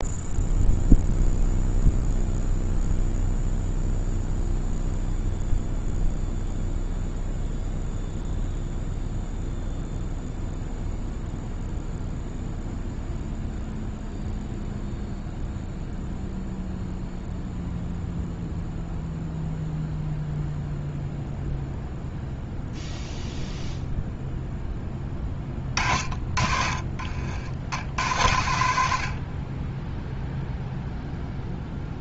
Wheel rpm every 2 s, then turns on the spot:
0, 0, 0, 0, 0, 0, 0, 0, 0, 0, 0, 0, 10, 40, 70, 0.
none